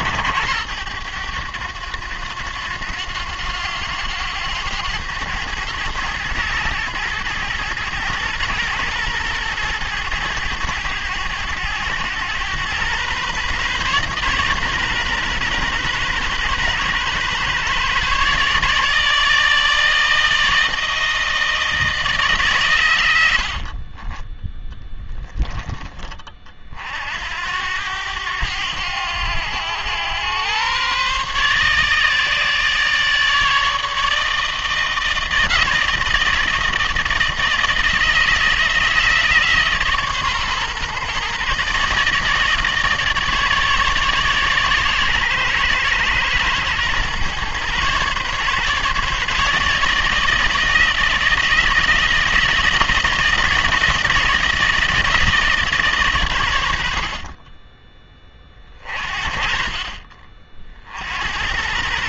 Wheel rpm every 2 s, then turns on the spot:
90, 90, 100, 110, 120, 110, 110, 140, 130, 150, 160, 130, 10, 40, 100, 120, 150, 160, 160, 160, 130, 160, 140, 120, 140, 160, 160, 160, 90, 30, 40.
24-26